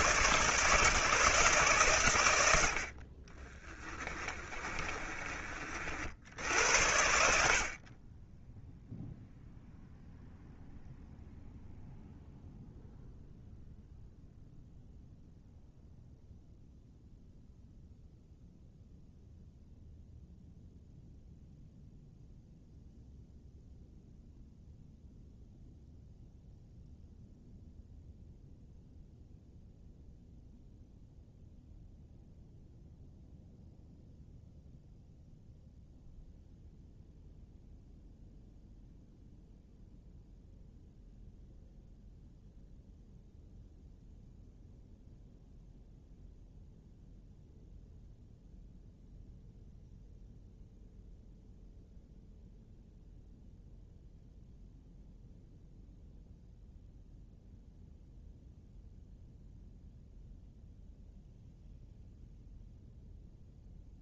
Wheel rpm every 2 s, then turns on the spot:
150, 60, 20, 70, 0, 0, 0, 0, 0, 0, 0, 0, 0, 0, 0, 0, 0, 0, 0, 0, 0, 0, 0, 0, 0, 0, 0, 0, 0, 0, 0, 0.
4-6